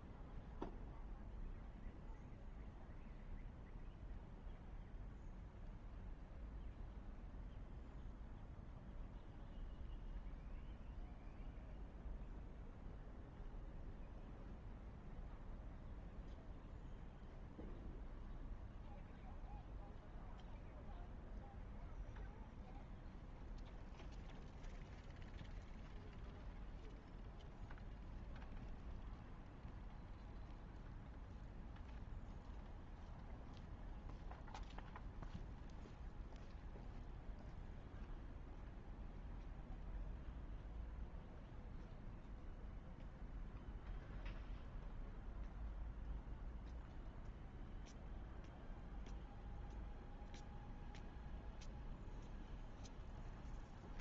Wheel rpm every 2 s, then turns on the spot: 0, 0, 0, 0, 0, 0, 0, 0, 0, 0, 0, 0, 0, 0, 0, 0, 0, 0, 0, 0, 0, 0, 0, 0, 0, 0, 0.
none